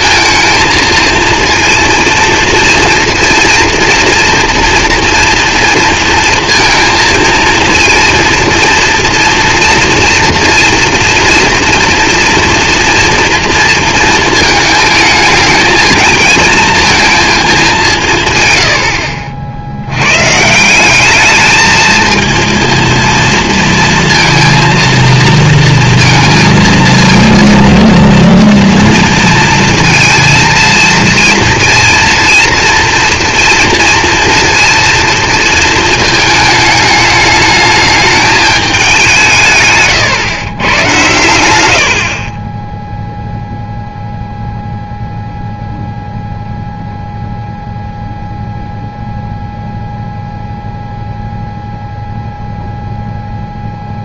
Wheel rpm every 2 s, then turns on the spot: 230, 230, 230, 230, 230, 230, 240, 230, 220, 170, 100, 220, 230, 230, 230, 230, 230, 230, 220, 210, 130, 30, 0, 0, 0, 0, 0.
none